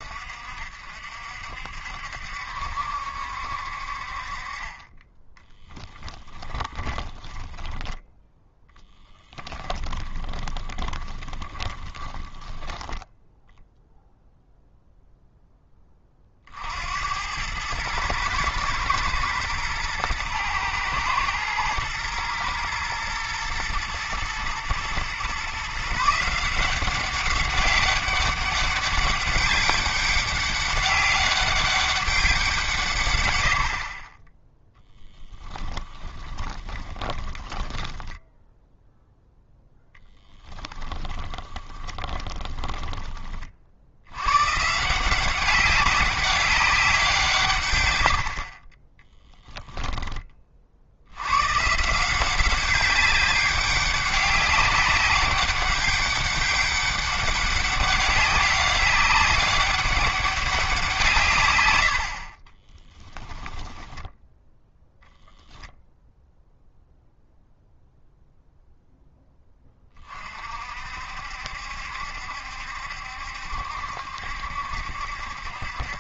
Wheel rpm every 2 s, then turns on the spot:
50, 70, 20, 10, 10, 20, 10, 0, 80, 110, 110, 110, 120, 190, 200, 200, 150, 10, 10, 0, 10, 20, 160, 190, 20, 70, 190, 190, 200, 200, 170, 20, 0, 0, 0, 60, 70, 70.
6-14 36-38 40-44 62-64